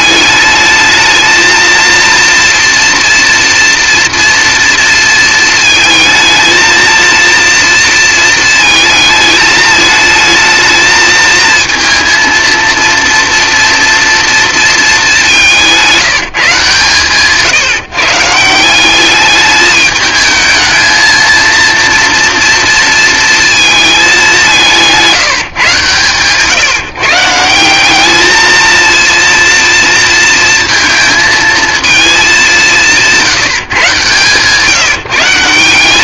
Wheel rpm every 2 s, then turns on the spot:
220, 240, 230, 230, 220, 220, 230, 210, 140, 190, 220, 230, 170, 160, 230, 230, 180, 150.
none